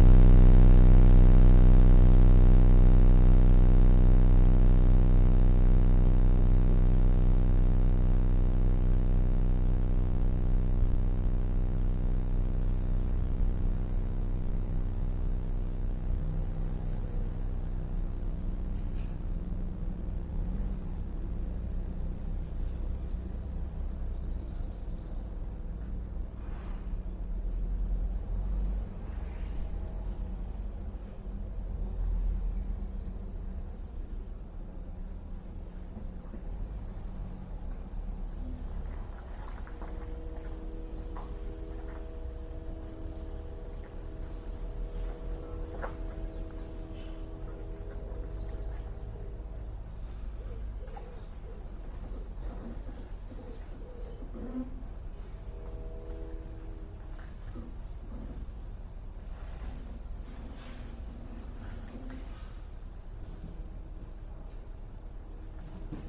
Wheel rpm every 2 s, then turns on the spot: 0, 0, 0, 0, 0, 0, 0, 0, 0, 0, 0, 0, 0, 0, 0, 0, 0, 0, 0, 0, 0, 0, 0, 0, 0, 0, 0, 0, 0, 0, 0, 0, 0.
none